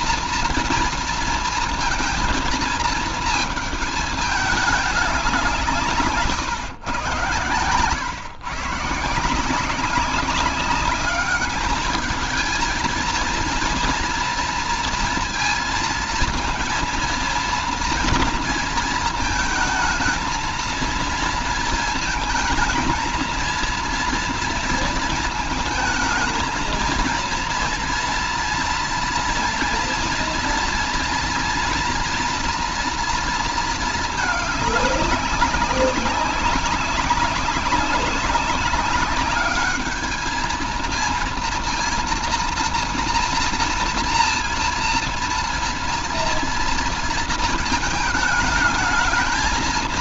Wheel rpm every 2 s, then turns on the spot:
230, 220, 200, 120, 160, 200, 230, 230, 230, 220, 230, 230, 220, 230, 230, 230, 240, 200, 190, 210, 230, 230, 230, 230, 220.
none